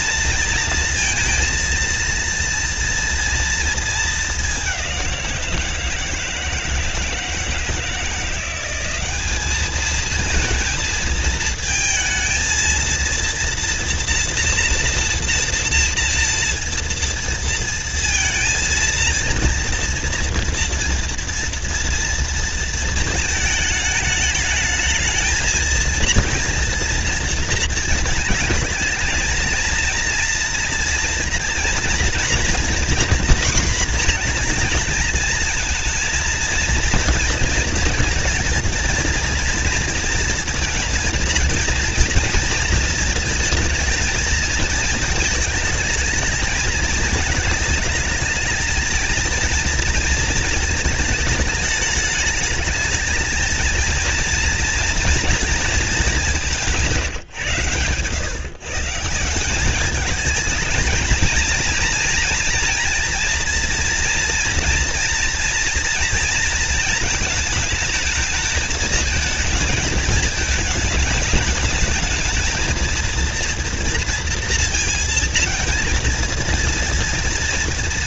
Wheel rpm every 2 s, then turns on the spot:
230, 230, 180, 160, 190, 230, 230, 240, 230, 230, 230, 220, 220, 230, 230, 230, 240, 220, 230, 230, 230, 230, 220, 220, 230, 220, 220, 230, 170, 170, 230, 230, 240, 230, 220, 210, 230, 230, 230.
none